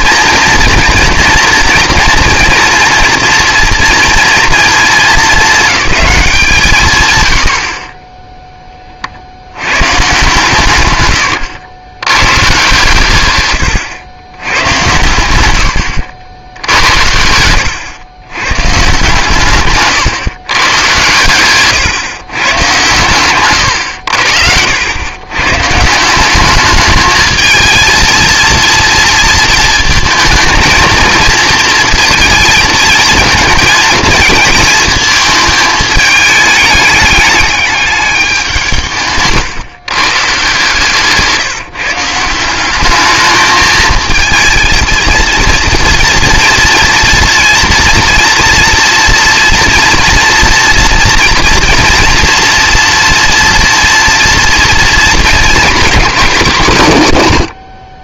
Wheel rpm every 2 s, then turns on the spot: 230, 230, 220, 140, 20, 110, 120, 100, 70, 140, 120, 130, 80, 210, 230, 230, 220, 220, 210, 170, 160, 200, 230, 230, 230, 230, 240, 230, 160.
none